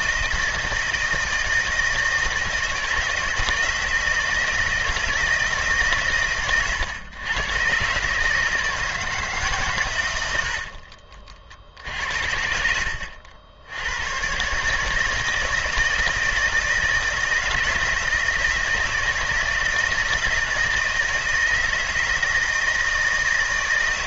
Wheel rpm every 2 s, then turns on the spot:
160, 160, 160, 120, 160, 60, 80, 150, 160, 160, 160, 160.
10-12